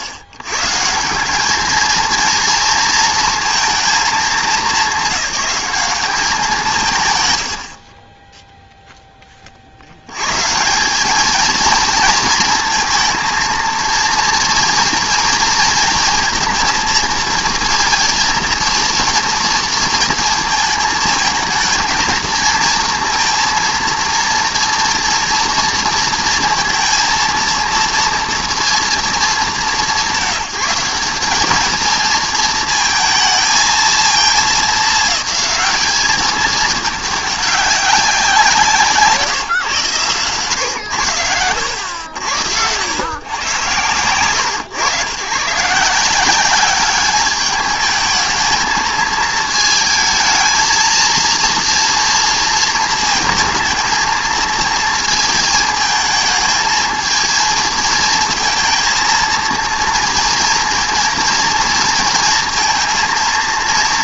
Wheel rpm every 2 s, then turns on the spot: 110, 230, 190, 190, 0, 180, 220, 230, 230, 230, 220, 230, 230, 230, 230, 180, 230, 210, 210, 170, 110, 110, 120, 200, 220, 230, 230, 220, 220, 230, 230, 230.
none